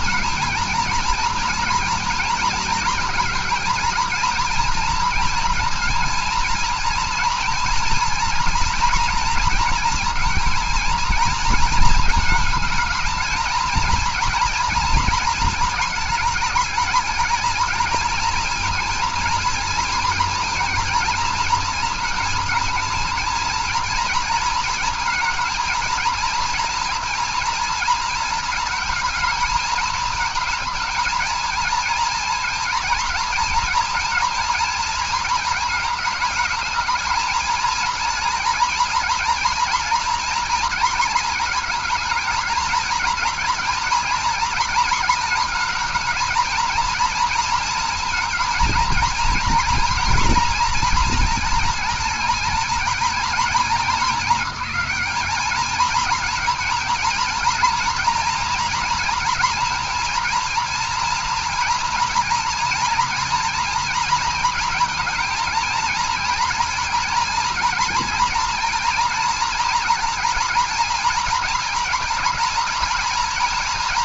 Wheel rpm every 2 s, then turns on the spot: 230, 230, 230, 230, 240, 230, 220, 230, 220, 230, 230, 230, 230, 230, 230, 230, 230, 230, 220, 240, 230, 230, 230, 230, 230, 230, 230, 210, 230, 230, 230, 230, 230, 230, 230, 230, 230.
none